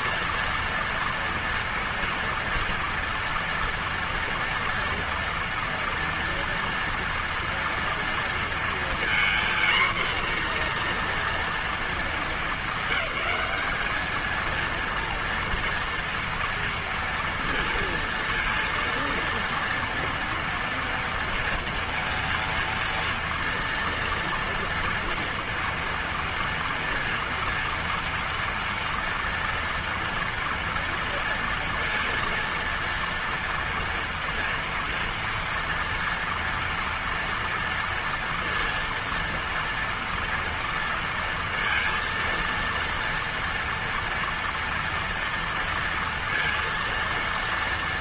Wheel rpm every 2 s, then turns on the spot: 230, 230, 230, 230, 230, 240, 200, 230, 230, 230, 240, 230, 240, 230, 230, 230, 230, 230, 230, 230, 230, 230, 230, 230.
none